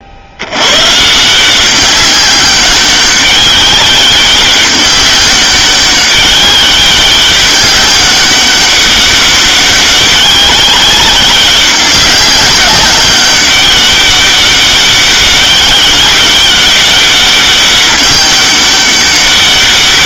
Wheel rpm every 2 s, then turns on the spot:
90, 200, 200, 190, 200, 190, 190, 200, 200, 200.
none